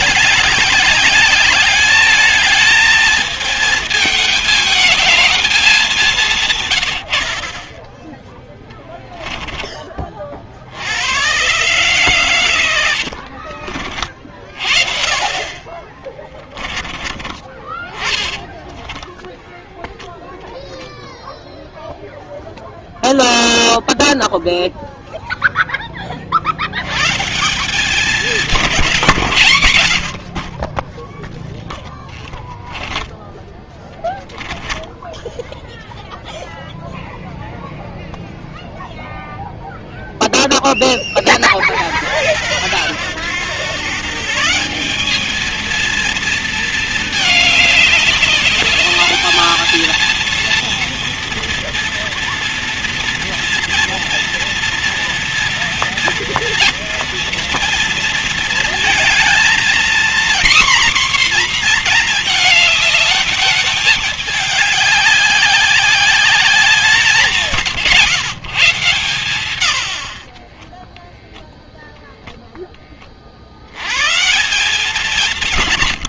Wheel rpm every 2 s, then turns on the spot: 200, 220, 220, 120, 10, 80, 90, 50, 30, 0, 0, 0, 0, 110, 160, 20, 10, 10, 0, 0, 10, 90, 180, 230, 210, 230, 230, 230, 230, 220, 250, 210, 200, 180, 130, 10, 10, 180.
8-10 12-14 34-36 70-72